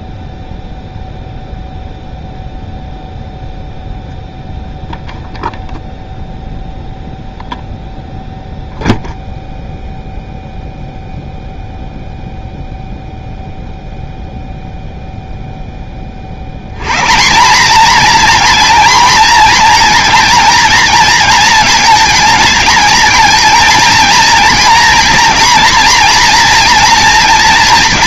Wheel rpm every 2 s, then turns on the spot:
0, 0, 0, 0, 0, 0, 0, 0, 100, 240, 230, 220, 240, 240.
none